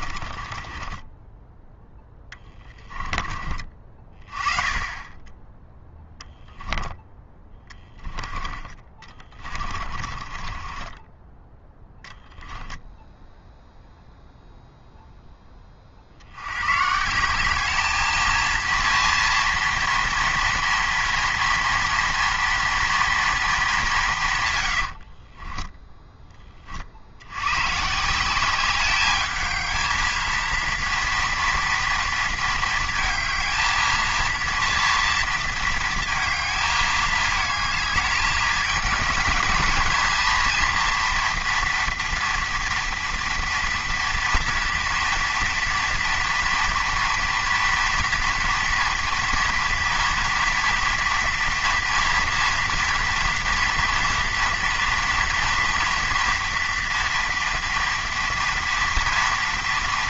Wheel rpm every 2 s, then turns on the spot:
30, 10, 30, 10, 20, 30, 0, 0, 110, 230, 230, 230, 120, 30, 190, 230, 230, 230, 220, 210, 230, 230, 230, 230, 230, 230, 230, 230, 230, 230.
0-4 6-8 10-12 24-26